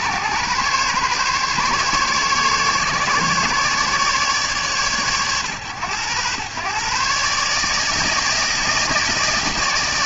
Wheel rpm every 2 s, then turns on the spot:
140, 140, 130, 110, 160.
none